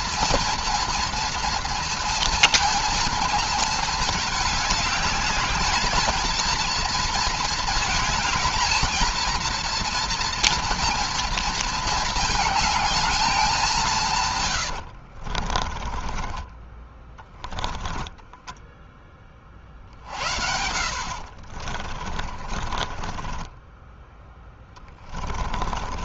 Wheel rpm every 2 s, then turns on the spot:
230, 220, 210, 230, 220, 230, 220, 120, 20, 10, 60, 30, 20.
14-16 18-26